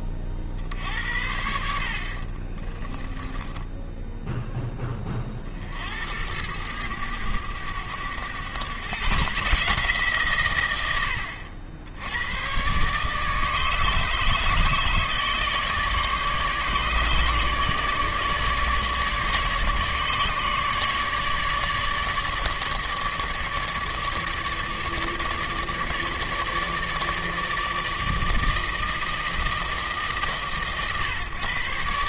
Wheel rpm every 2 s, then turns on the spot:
50, 30, 20, 100, 140, 80, 140, 150, 150, 150, 150, 150, 150, 150, 160, 140.
2-4